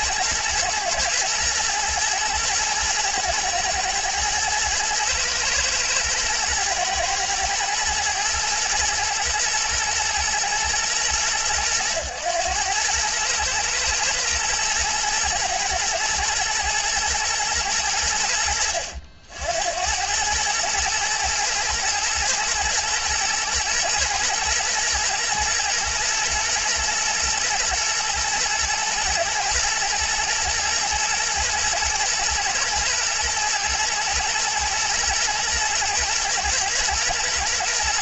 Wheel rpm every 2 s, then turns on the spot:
120, 110, 110, 120, 110, 110, 110, 110, 110, 80, 110, 110, 110, 110, 120, 120, 110, 120, 110.
none